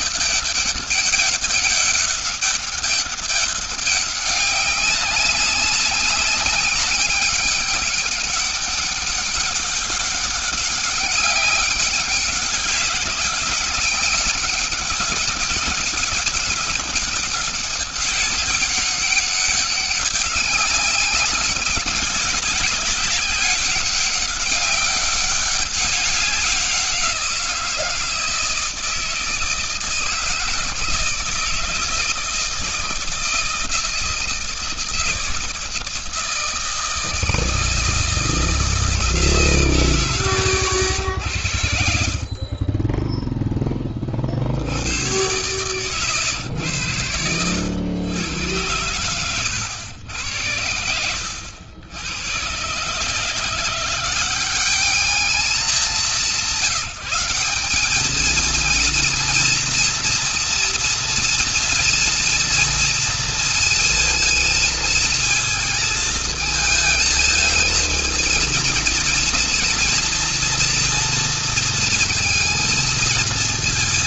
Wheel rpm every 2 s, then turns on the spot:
200, 200, 200, 190, 200, 190, 190, 200, 200, 200, 200, 210, 200, 190, 160, 160, 160, 160, 160, 160, 110, 30, 70, 100, 110, 90, 110, 190, 190, 220, 230, 230, 230, 220, 230, 230, 230.
none